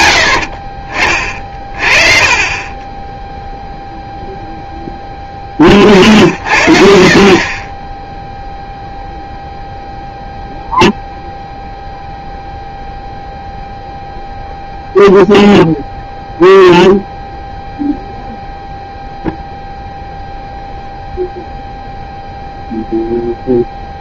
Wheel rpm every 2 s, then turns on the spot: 50, 20, 10, 60, 0, 0, 0, 0, 0, 0, 0, 0.
2-4 6-8